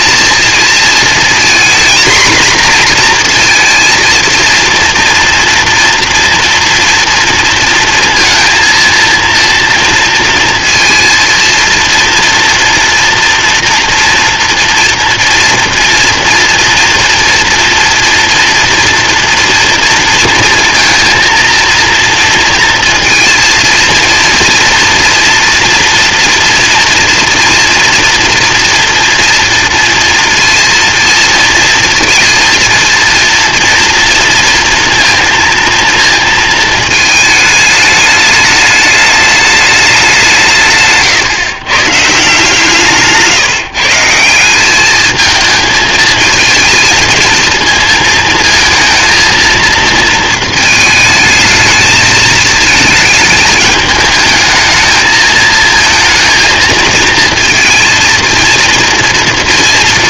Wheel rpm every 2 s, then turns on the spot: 220, 240, 230, 230, 230, 230, 230, 230, 230, 240, 230, 230, 230, 230, 240, 230, 230, 230, 230, 210, 160, 160, 190, 220, 220, 220, 220, 220, 230, 230.
none